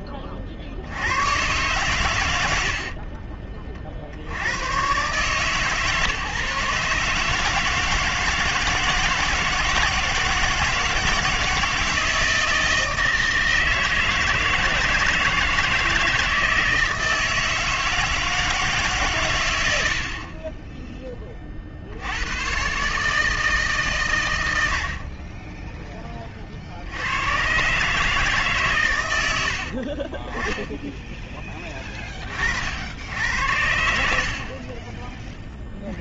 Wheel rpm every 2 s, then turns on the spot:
80, 30, 120, 140, 160, 160, 160, 160, 160, 150, 30, 150, 20, 120, 90, 10, 80, 10.
2-4